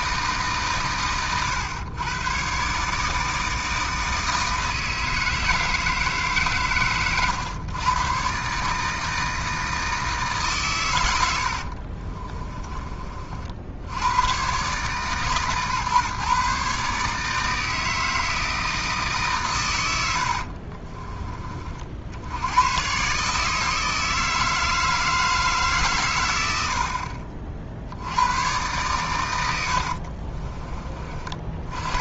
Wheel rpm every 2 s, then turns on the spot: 130, 140, 160, 130, 150, 110, 30, 140, 140, 160, 50, 120, 160, 70, 120, 30.
20-22